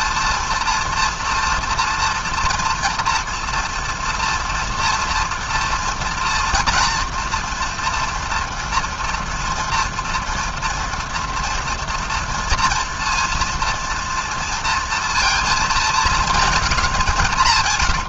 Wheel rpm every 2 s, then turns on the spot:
230, 230, 230, 240, 230, 230, 240, 230, 200.
none